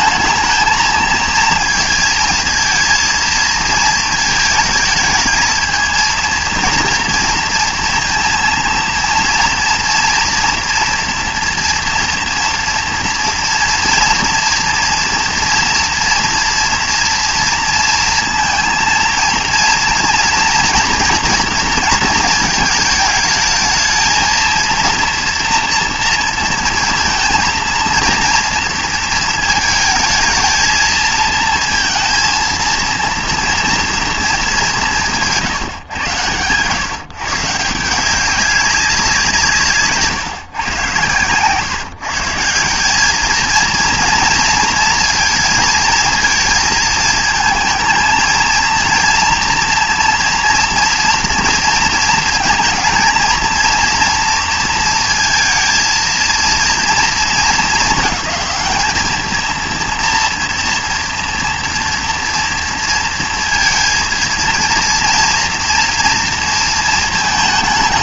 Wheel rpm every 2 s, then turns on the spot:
220, 220, 220, 230, 230, 240, 230, 240, 230, 230, 230, 230, 230, 230, 230, 220, 230, 180, 130, 190, 120, 180, 230, 230, 230, 230, 220, 230, 230, 220, 230, 230, 230, 220.
none